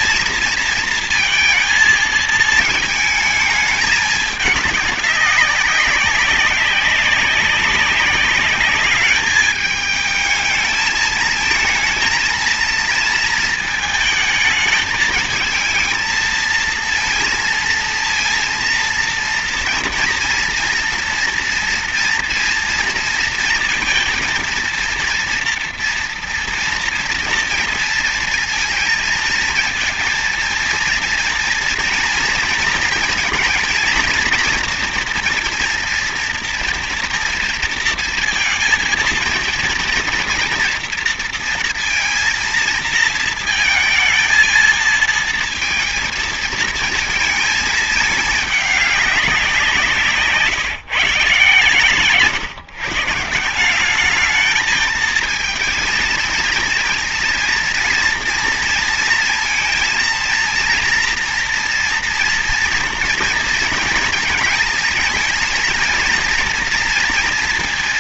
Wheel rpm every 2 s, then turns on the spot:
230, 220, 210, 200, 200, 220, 230, 220, 230, 230, 230, 230, 230, 230, 230, 230, 230, 240, 240, 230, 230, 230, 220, 230, 210, 170, 160, 210, 230, 230, 230, 230, 220, 230.
none